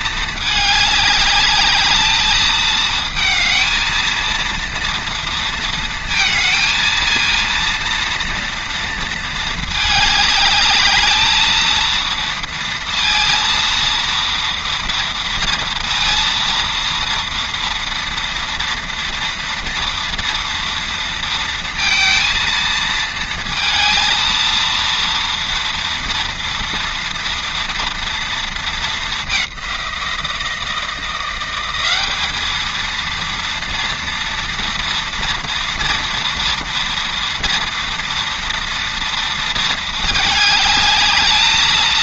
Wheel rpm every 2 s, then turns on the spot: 200, 220, 230, 230, 230, 220, 230, 230, 230, 230, 230, 230, 230, 230, 210, 170, 230, 230, 230, 230, 210.
none